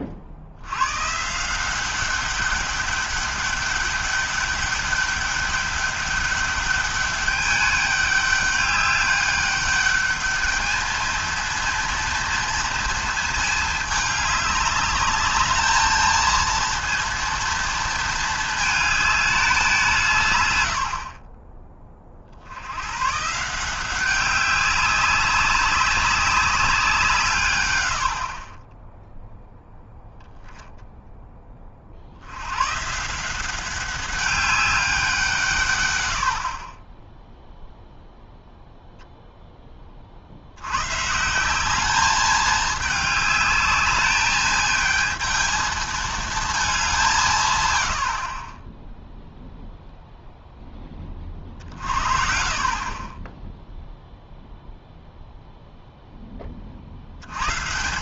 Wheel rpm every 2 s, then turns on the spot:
70, 200, 200, 200, 200, 220, 230, 200, 230, 220, 90, 90, 190, 200, 30, 0, 120, 200, 40, 0, 90, 210, 220, 210, 20, 10, 40, 0, 40.
none